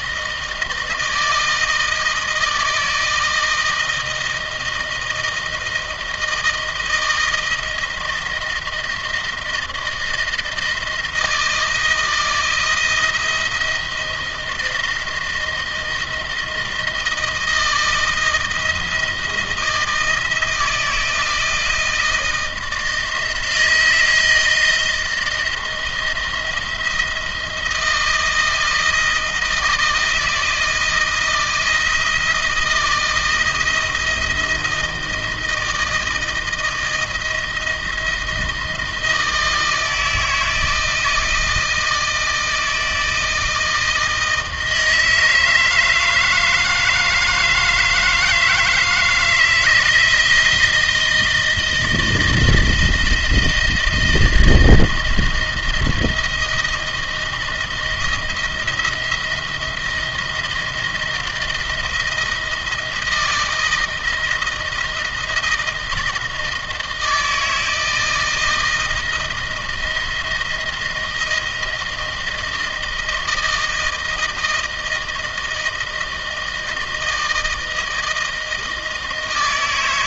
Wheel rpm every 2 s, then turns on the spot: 160, 160, 160, 160, 160, 160, 160, 160, 160, 160, 160, 160, 170, 170, 160, 170, 160, 160, 160, 160, 160, 160, 160, 160, 160, 160, 160, 160, 170, 170, 160, 160, 160, 160, 160, 170, 160, 160, 160, 160.
none